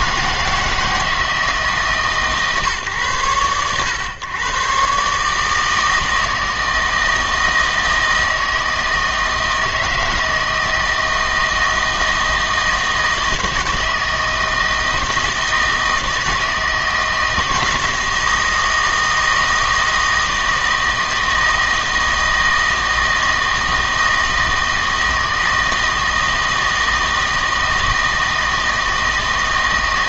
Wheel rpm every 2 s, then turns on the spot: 160, 140, 130, 160, 160, 160, 160, 160, 160, 160, 160, 160, 160, 160, 160.
none